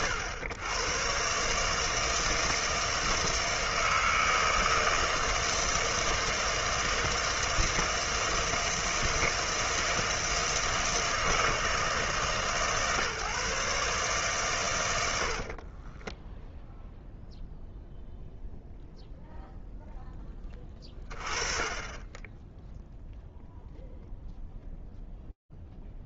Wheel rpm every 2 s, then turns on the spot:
100, 160, 160, 160, 160, 160, 140, 100, 0, 0, 20, 10, 0.
none